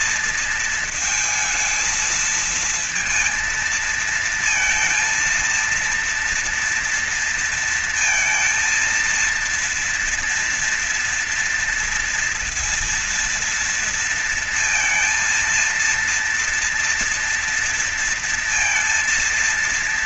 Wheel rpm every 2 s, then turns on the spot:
230, 220, 230, 230, 230, 230, 230, 230, 230, 230.
none